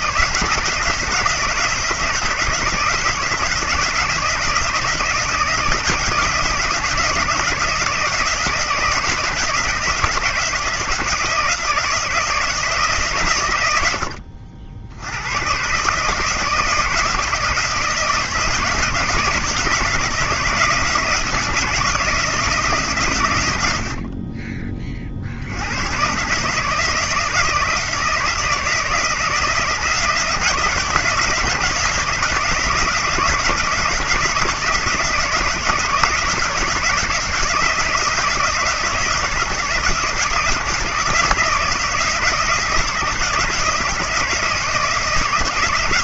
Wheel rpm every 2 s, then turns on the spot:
160, 160, 160, 160, 160, 160, 130, 70, 160, 160, 160, 130, 40, 160, 160, 160, 160, 160, 170, 160, 160, 160, 160.
none